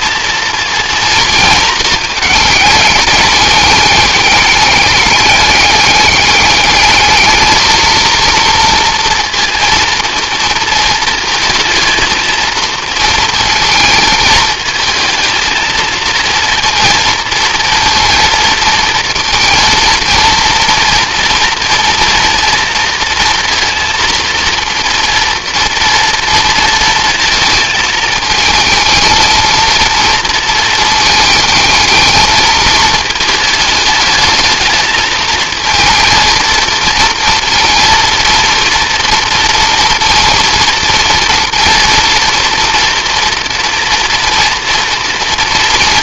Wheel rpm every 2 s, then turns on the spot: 230, 210, 210, 220, 230, 220, 230, 220, 230, 230, 230, 230, 230, 230, 220, 230, 220, 220, 230, 230, 230, 230, 230.
none